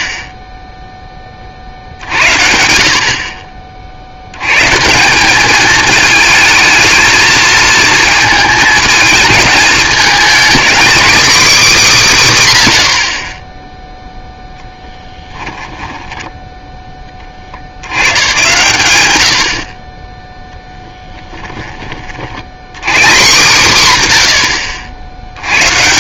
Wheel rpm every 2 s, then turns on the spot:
0, 60, 150, 220, 220, 270, 60, 10, 10, 110, 10, 140, 80.
20-22